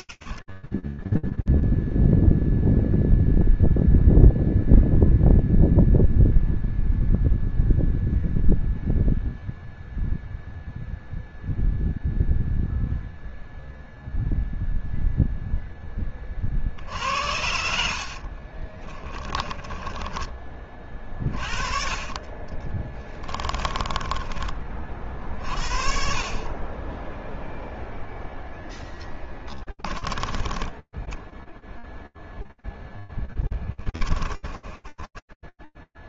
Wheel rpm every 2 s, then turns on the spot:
100, 0, 0, 0, 0, 0, 0, 0, 50, 20, 30, 20, 40, 10, 40, 10, 20, 20.
16-20 22-24 28-36